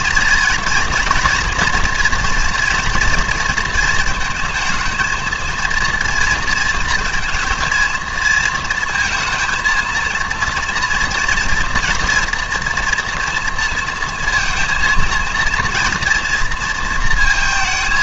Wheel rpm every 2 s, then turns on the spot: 230, 230, 220, 230, 230, 230, 230, 230, 230.
none